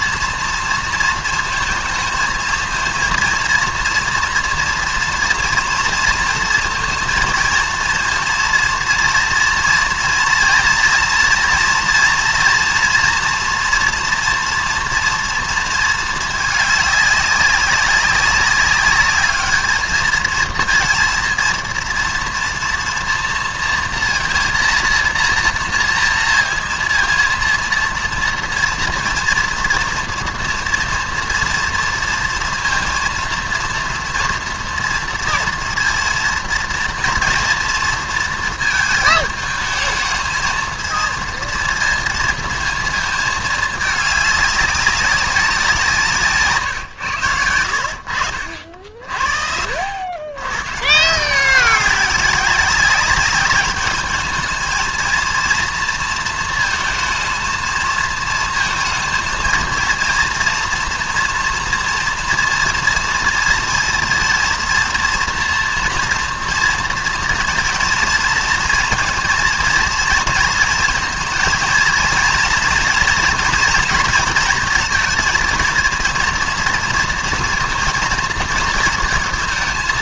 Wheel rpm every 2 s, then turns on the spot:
230, 220, 230, 230, 230, 230, 240, 230, 220, 200, 220, 230, 230, 230, 230, 230, 230, 230, 230, 230, 220, 230, 210, 160, 60, 90, 200, 210, 230, 220, 230, 230, 230, 230, 230, 230, 230, 230, 230, 230.
none